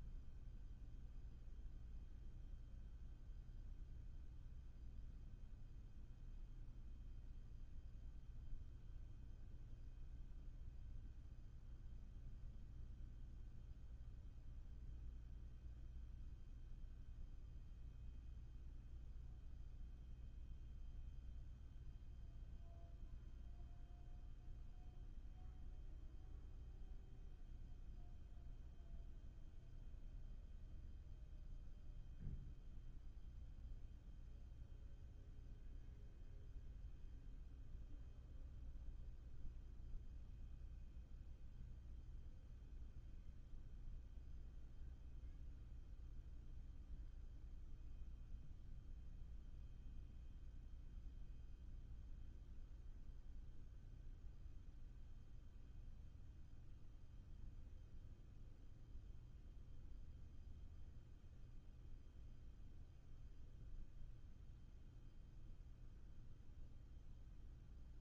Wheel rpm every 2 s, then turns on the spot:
0, 0, 0, 0, 0, 0, 0, 0, 0, 0, 0, 0, 0, 0, 0, 0, 0, 0, 0, 0, 0, 0, 0, 0, 0, 0, 0, 0, 0, 0, 0, 0, 0, 0.
none